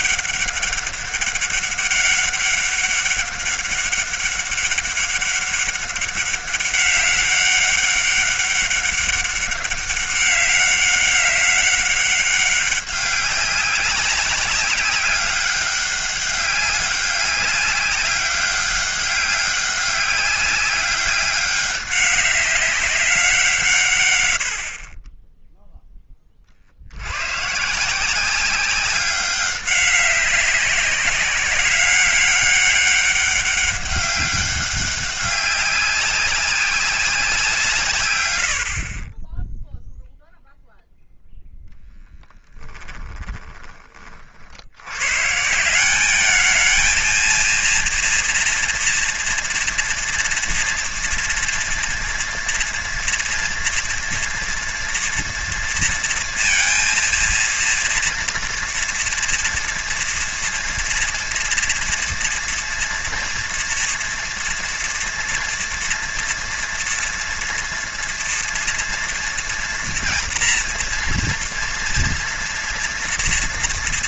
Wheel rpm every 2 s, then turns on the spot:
200, 200, 200, 200, 200, 200, 190, 190, 200, 200, 200, 190, 50, 80, 200, 190, 200, 200, 190, 40, 0, 20, 80, 220, 230, 230, 230, 230, 230, 230, 230, 240, 230, 230, 230, 240, 230.
42-44